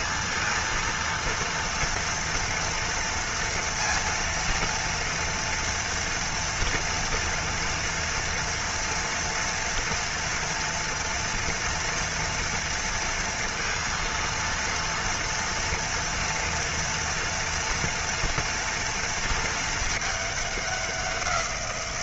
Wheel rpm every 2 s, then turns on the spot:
230, 230, 230, 230, 230, 240, 230, 230, 230, 230, 200.
none